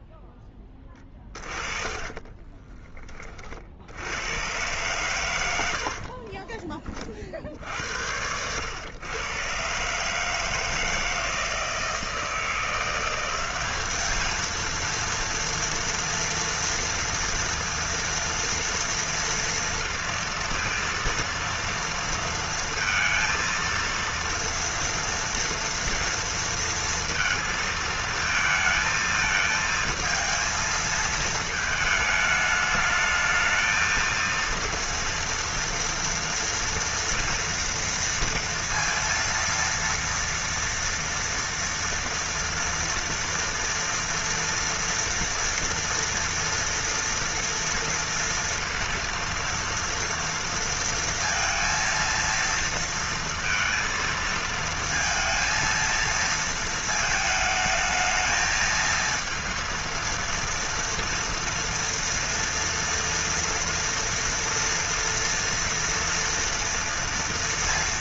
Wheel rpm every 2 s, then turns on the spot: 20, 20, 120, 30, 110, 160, 170, 230, 230, 230, 230, 230, 240, 230, 220, 220, 210, 230, 230, 230, 230, 230, 230, 230, 230, 230, 230, 230, 220, 220, 230, 230, 240, 230.
0-2